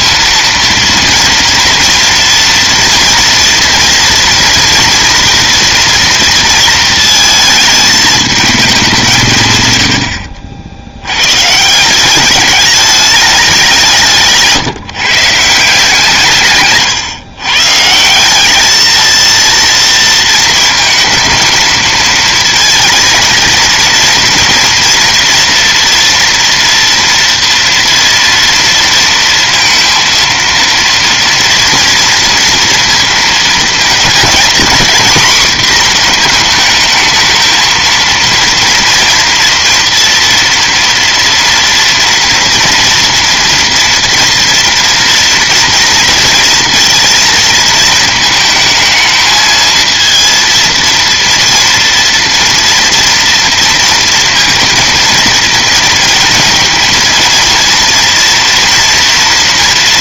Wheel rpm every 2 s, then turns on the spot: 230, 230, 240, 230, 190, 70, 210, 150, 130, 210, 220, 230, 230, 230, 230, 230, 230, 230, 220, 230, 230, 230, 230, 230, 220, 230, 230, 230, 230, 230.
none